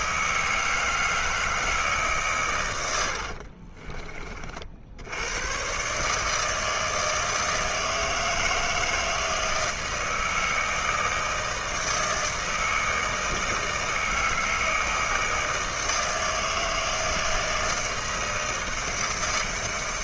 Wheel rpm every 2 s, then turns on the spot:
160, 110, 60, 160, 160, 160, 160, 160, 160, 160.
none